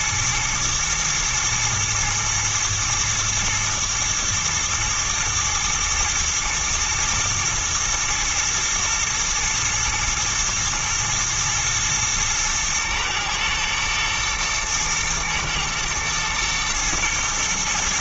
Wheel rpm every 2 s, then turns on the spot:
110, 110, 110, 120, 120, 110, 110, 110, 110.
none